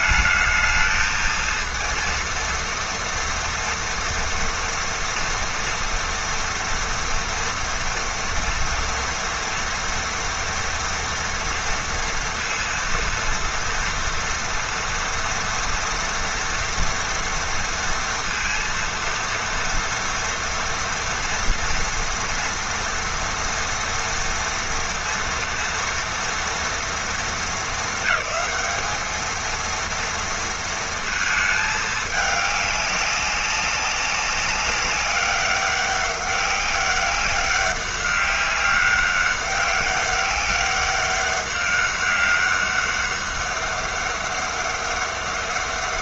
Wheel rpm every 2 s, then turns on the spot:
220, 230, 230, 240, 230, 230, 230, 230, 230, 230, 230, 240, 230, 230, 220, 230, 210, 200, 200, 200, 200, 200, 200.
none